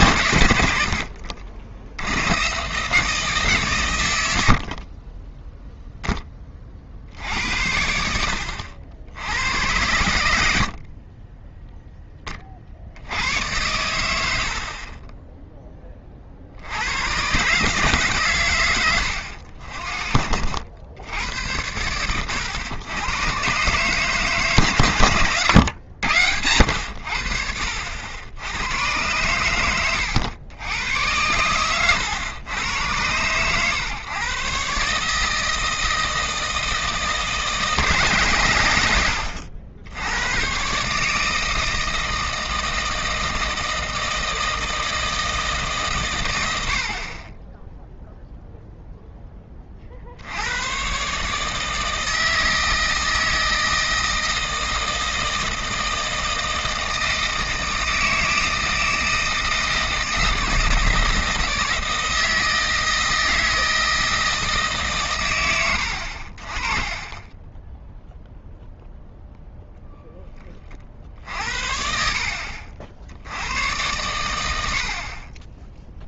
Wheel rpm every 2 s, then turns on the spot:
110, 130, 70, 40, 70, 60, 50, 60, 70, 120, 70, 110, 130, 90, 100, 100, 110, 130, 160, 110, 130, 160, 160, 70, 0, 100, 160, 160, 160, 160, 160, 160, 160, 30, 0, 20, 60, 70.
72-74